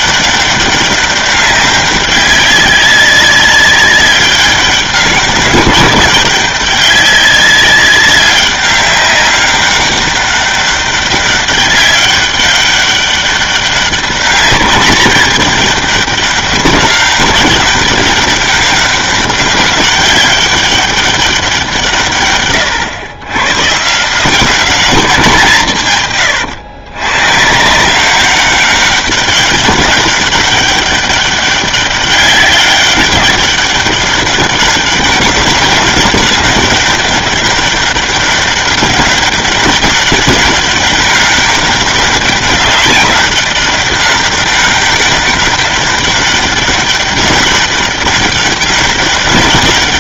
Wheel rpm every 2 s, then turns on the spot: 200, 190, 200, 200, 200, 200, 200, 200, 200, 190, 200, 110, 200, 120, 200, 200, 200, 200, 190, 200, 200, 200, 200, 200, 200.
none